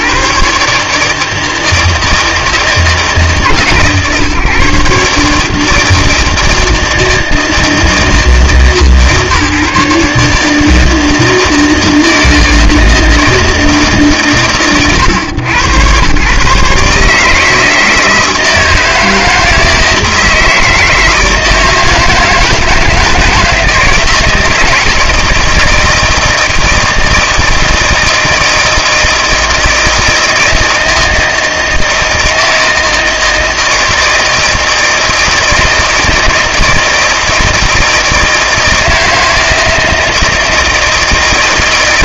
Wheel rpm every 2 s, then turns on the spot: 140, 160, 150, 160, 160, 160, 160, 120, 140, 160, 160, 160, 160, 160, 160, 160, 160, 160, 160, 160, 160.
none